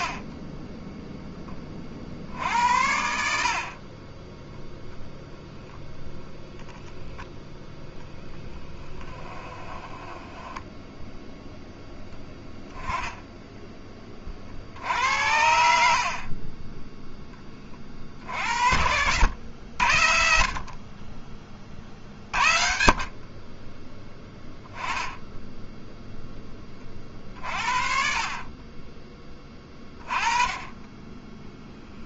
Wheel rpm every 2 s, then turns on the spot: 20, 70, 0, 0, 10, 10, 10, 60, 10, 80, 40, 50, 10, 30, 20, 20.
8-12